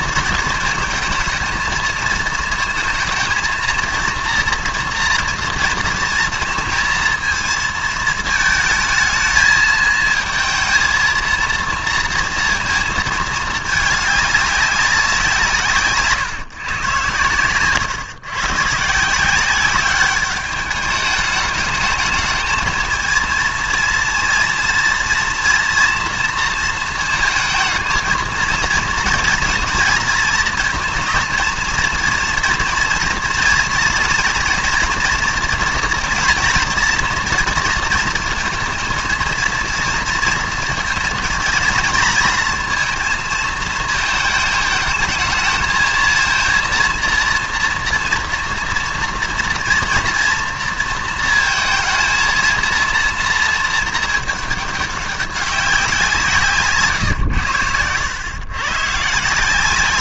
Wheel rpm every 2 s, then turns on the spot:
230, 220, 230, 230, 220, 230, 230, 200, 130, 140, 210, 220, 230, 230, 230, 230, 230, 230, 230, 230, 230, 230, 220, 230, 230, 230, 230, 210, 150, 130.
none